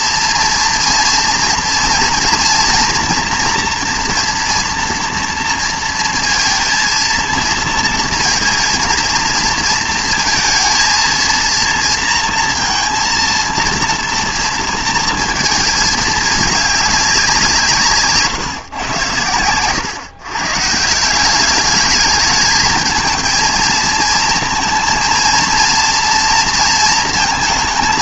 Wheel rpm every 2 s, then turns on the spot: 230, 230, 240, 230, 230, 230, 230, 230, 210, 120, 150, 220, 230, 230.
none